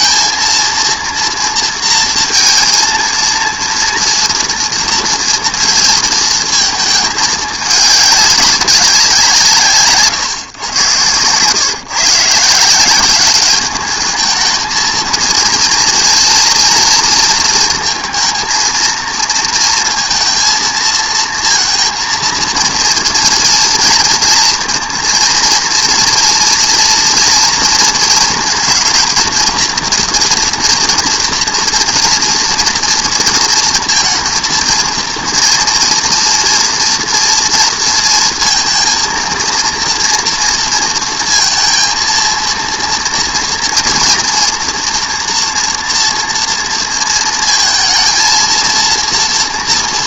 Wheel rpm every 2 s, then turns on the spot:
230, 230, 230, 220, 190, 110, 170, 220, 230, 230, 230, 230, 230, 230, 220, 230, 230, 230, 230, 230, 230, 230, 230, 230, 230.
none